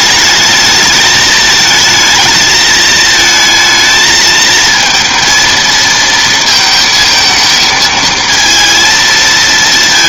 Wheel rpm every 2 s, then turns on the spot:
210, 220, 220, 230, 230.
none